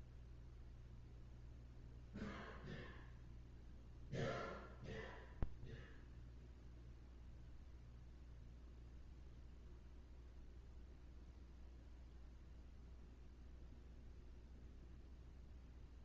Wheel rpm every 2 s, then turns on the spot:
0, 0, 0, 0, 0, 0, 0, 0.
none